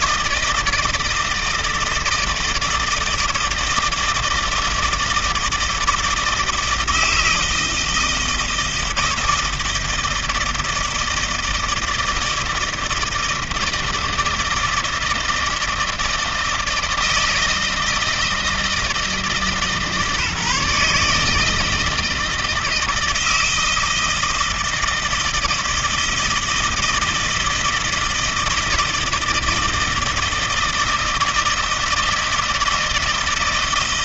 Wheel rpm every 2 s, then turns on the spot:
160, 160, 160, 160, 160, 160, 160, 160, 160, 160, 150, 160, 160, 160, 160, 160, 160.
none